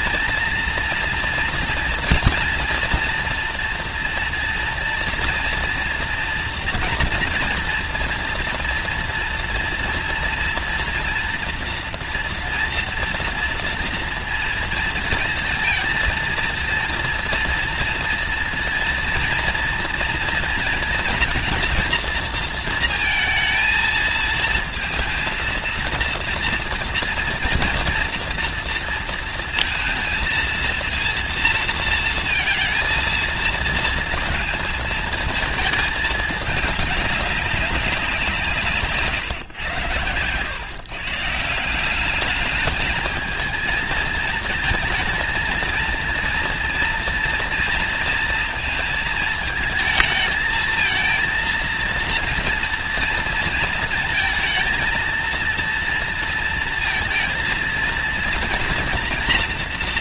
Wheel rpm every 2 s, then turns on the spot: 230, 230, 240, 230, 230, 240, 230, 230, 230, 230, 230, 230, 230, 230, 230, 230, 230, 230, 210, 160, 120, 210, 230, 230, 230, 220, 230, 230, 230, 230.
none